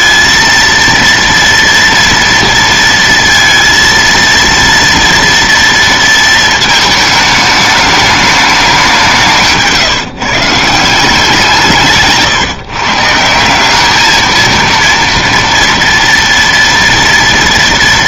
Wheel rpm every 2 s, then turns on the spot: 230, 230, 230, 220, 210, 150, 150, 220, 230.
none